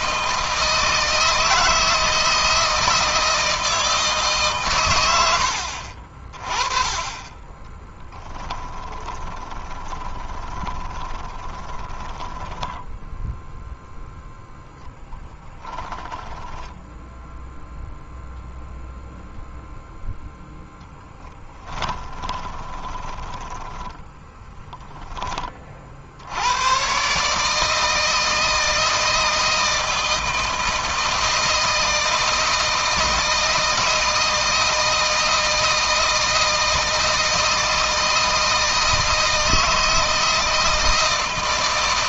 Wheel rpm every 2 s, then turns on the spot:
160, 160, 110, 20, 20, 20, 10, 0, 10, 0, 10, 10, 20, 130, 160, 160, 160, 160, 160, 160, 160.
8-14 16-18 20-24